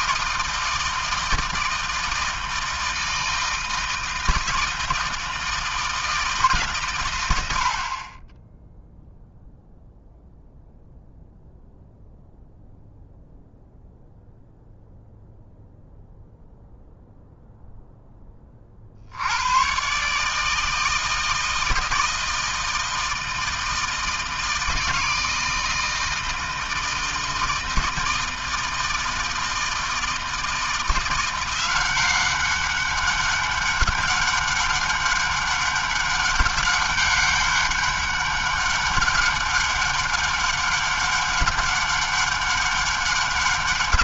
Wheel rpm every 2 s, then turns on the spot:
160, 160, 160, 110, 0, 0, 0, 0, 0, 70, 160, 160, 160, 160, 160, 170, 200, 200, 200, 200, 200, 200.
none